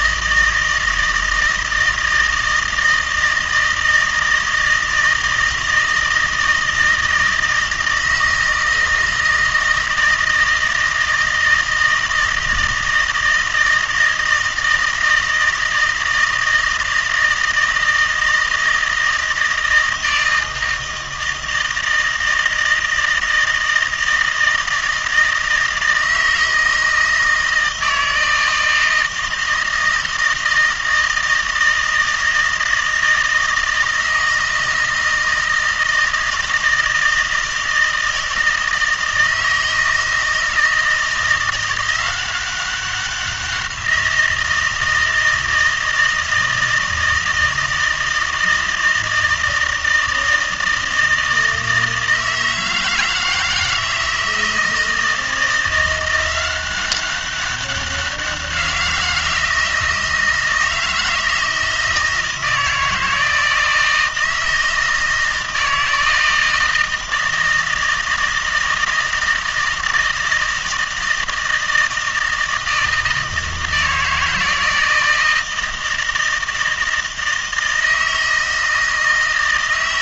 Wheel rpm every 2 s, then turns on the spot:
160, 160, 160, 160, 160, 160, 160, 160, 160, 160, 160, 160, 160, 160, 160, 160, 160, 160, 160, 160, 160, 190, 170, 160, 160, 160, 160, 160, 190, 180, 160, 160, 160, 160, 160, 160, 160, 160, 160, 160.
none